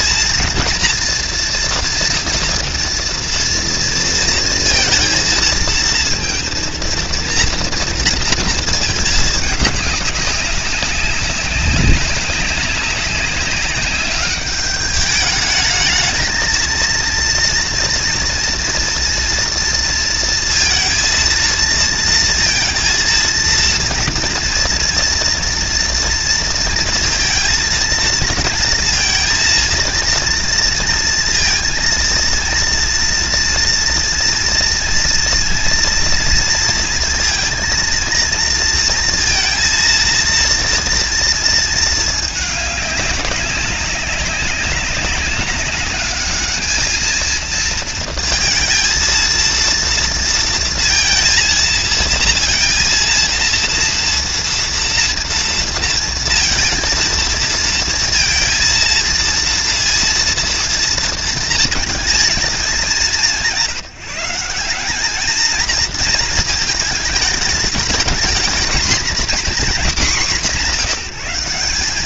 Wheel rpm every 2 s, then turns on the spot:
230, 240, 230, 230, 230, 200, 200, 200, 220, 230, 230, 230, 230, 230, 230, 230, 230, 230, 230, 230, 230, 220, 190, 210, 230, 230, 230, 230, 230, 230, 230, 220, 170, 230, 220, 230.
none